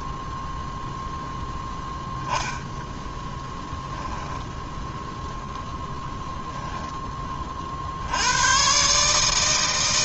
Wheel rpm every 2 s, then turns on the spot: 0, 10, 10, 20, 150.
2-4